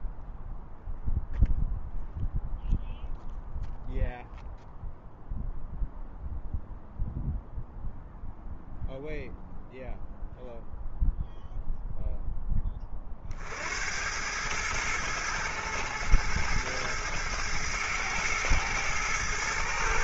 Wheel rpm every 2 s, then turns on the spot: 0, 0, 0, 0, 0, 0, 20, 110, 110, 110.
none